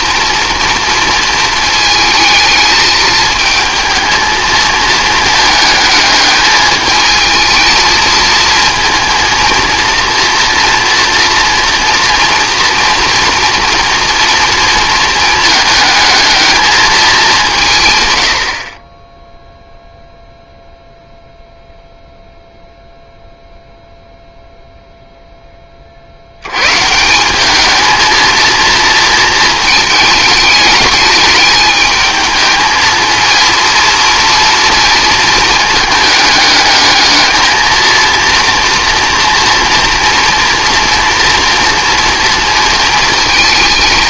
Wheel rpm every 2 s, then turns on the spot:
230, 220, 220, 220, 230, 230, 230, 230, 220, 30, 0, 0, 0, 150, 230, 210, 220, 230, 210, 230, 230, 230.
none